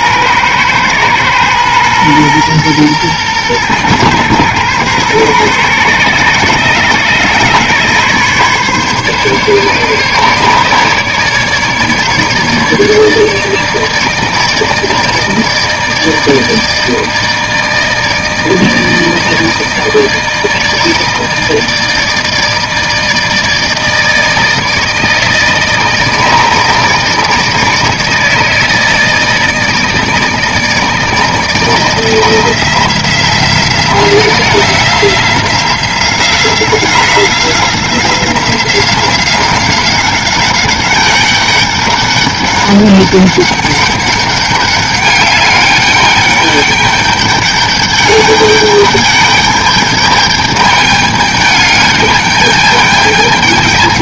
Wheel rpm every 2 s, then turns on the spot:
120, 120, 120, 130, 140, 150, 150, 160, 160, 160, 160, 160, 160, 160, 160, 160, 170, 180, 180, 190, 200, 200, 200, 200, 210, 210, 210.
none